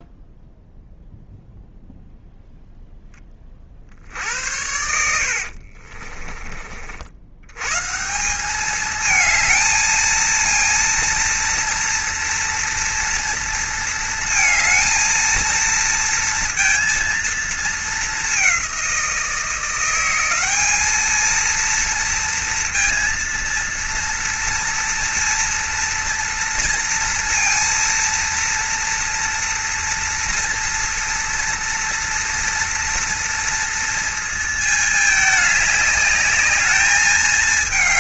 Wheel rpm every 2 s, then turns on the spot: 0, 10, 70, 70, 220, 230, 230, 220, 230, 180, 220, 230, 230, 230, 230, 230, 230, 210, 210.
4-6